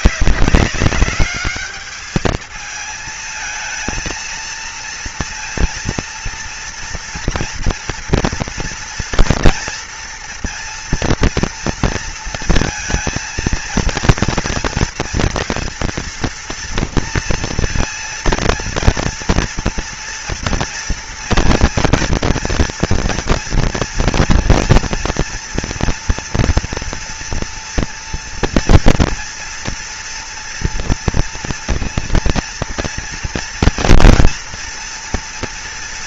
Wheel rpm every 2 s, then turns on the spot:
190, 220, 230, 230, 230, 230, 230, 230, 230, 230, 230, 230, 240, 230, 230, 230, 230, 230.
none